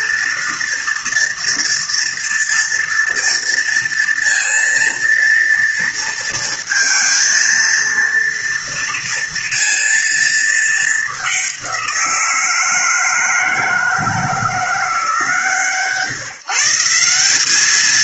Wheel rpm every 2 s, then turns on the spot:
230, 230, 230, 230, 230, 220, 170, 160, 150.
none